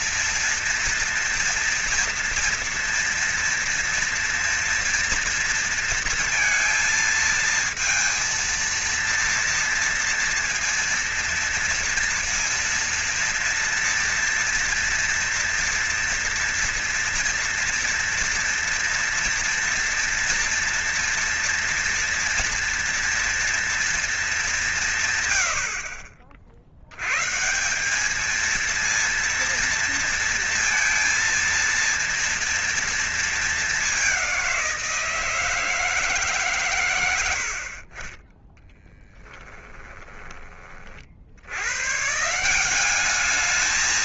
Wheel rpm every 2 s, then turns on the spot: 230, 240, 230, 230, 230, 230, 230, 230, 230, 230, 230, 230, 190, 70, 220, 230, 230, 180, 130, 20, 30, 170.
38-40